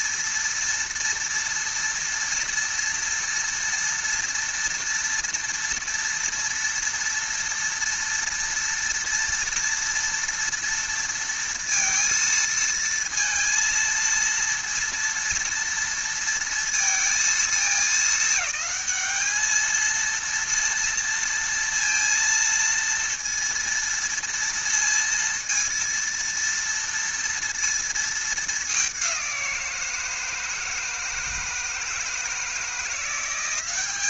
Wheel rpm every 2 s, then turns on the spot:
230, 230, 230, 230, 230, 230, 230, 230, 230, 210, 230, 230, 230, 230, 200, 160, 170.
none